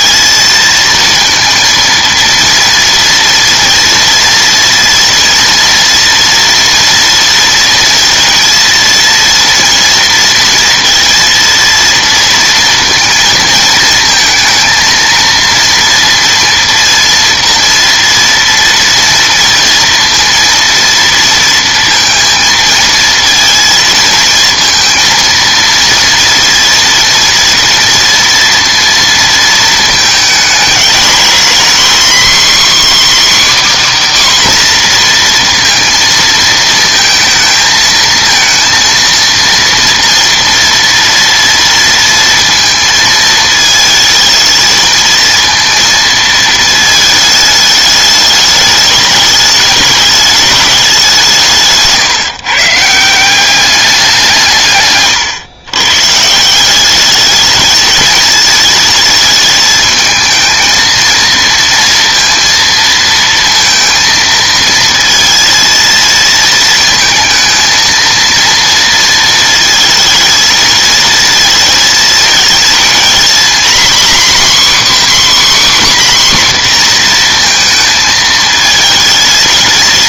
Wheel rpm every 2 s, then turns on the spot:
230, 230, 230, 230, 230, 230, 230, 230, 230, 230, 230, 230, 230, 230, 230, 220, 280, 260, 220, 230, 230, 220, 220, 220, 210, 200, 150, 140, 190, 220, 220, 230, 230, 230, 230, 220, 230, 280, 250, 220.
54-56